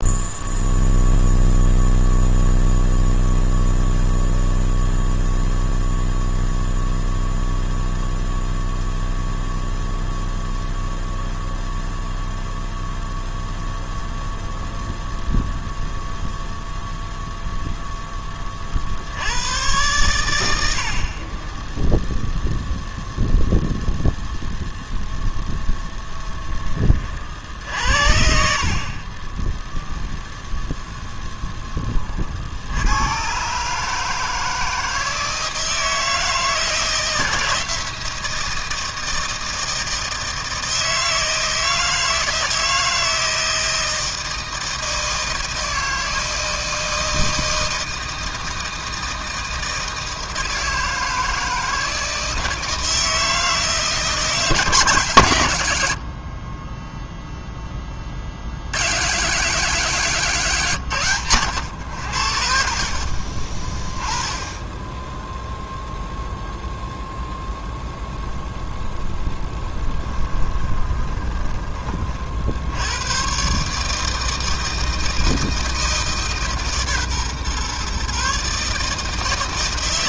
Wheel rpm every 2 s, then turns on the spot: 0, 0, 0, 0, 0, 0, 0, 0, 0, 30, 80, 0, 0, 20, 60, 0, 60, 160, 160, 160, 160, 160, 160, 160, 160, 160, 160, 150, 30, 80, 160, 60, 20, 0, 0, 20, 60, 160, 150, 150.
70-72